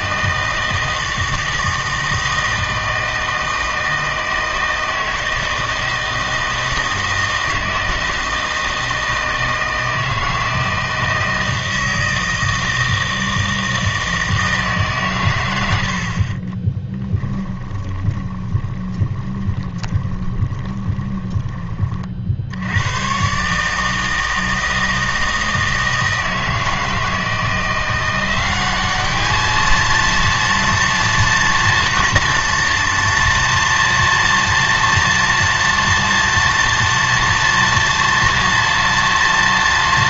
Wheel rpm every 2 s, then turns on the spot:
160, 160, 160, 160, 160, 160, 160, 150, 20, 20, 20, 80, 160, 160, 190, 230, 240, 230, 230, 240.
16-22